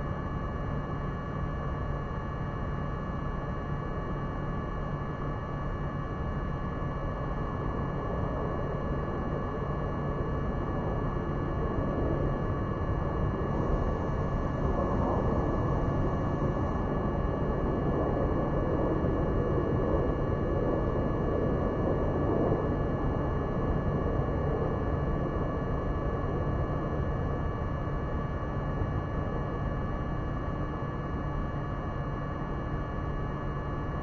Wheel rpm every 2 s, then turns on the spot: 0, 0, 0, 0, 0, 0, 0, 0, 0, 0, 0, 0, 0, 0, 0, 0, 0.
none